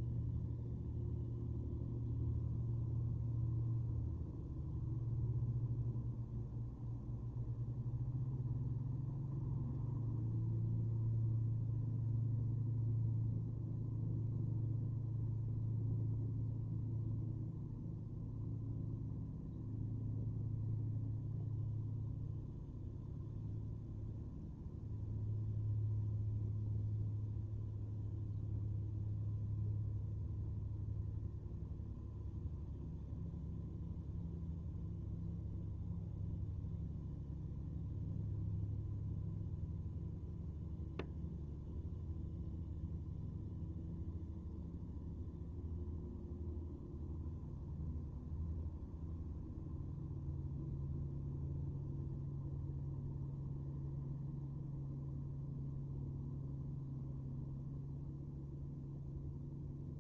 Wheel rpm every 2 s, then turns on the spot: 0, 0, 0, 0, 0, 0, 0, 0, 0, 0, 0, 0, 0, 0, 0, 0, 0, 0, 0, 0, 0, 0, 0, 0, 0, 0, 0, 0, 0, 0.
none